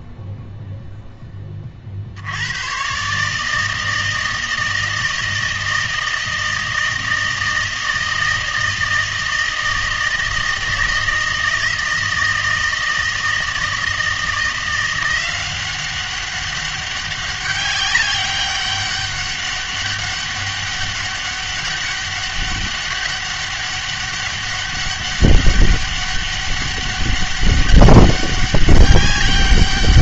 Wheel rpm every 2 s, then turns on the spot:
0, 110, 160, 160, 160, 160, 160, 170, 200, 200, 200, 200, 200, 200, 200.
none